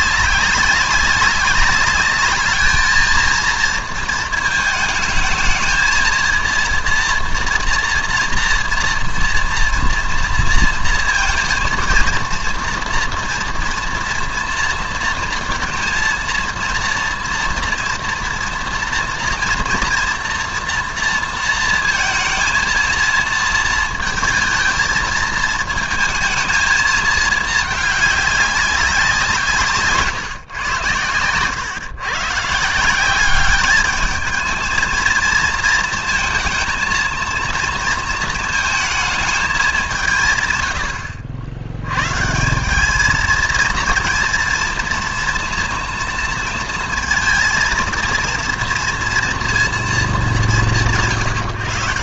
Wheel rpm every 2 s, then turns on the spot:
200, 210, 220, 230, 230, 230, 230, 230, 230, 230, 230, 220, 230, 220, 200, 120, 160, 220, 230, 230, 110, 180, 230, 230, 230, 190.
none